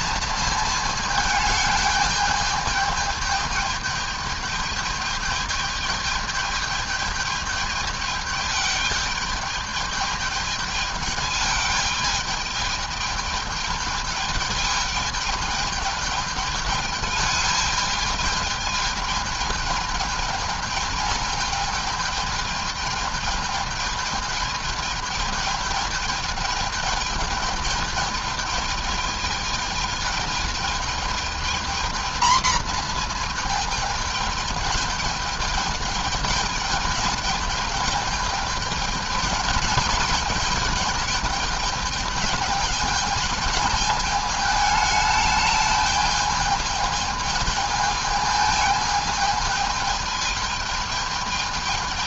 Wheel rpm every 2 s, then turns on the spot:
220, 210, 210, 210, 210, 220, 210, 210, 210, 210, 210, 220, 210, 210, 210, 220, 220, 220, 210, 220, 220, 210, 210, 210, 220, 210.
none